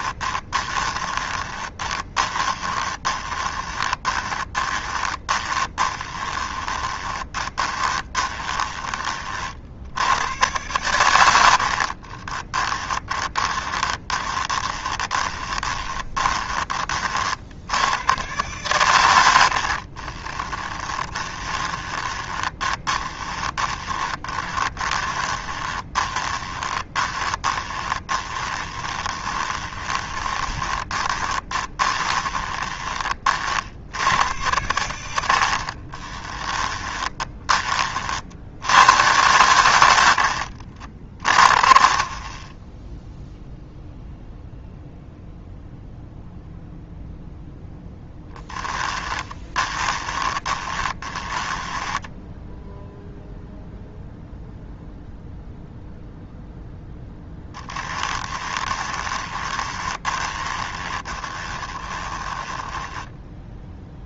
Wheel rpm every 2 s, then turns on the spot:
20, 20, 30, 20, 20, 100, 10, 20, 30, 110, 10, 20, 20, 20, 20, 20, 20, 100, 20, 80, 50, 0, 0, 0, 10, 20, 0, 0, 0, 20, 20, 10.
0-8 12-16 20-32 34-38 48-52 58-64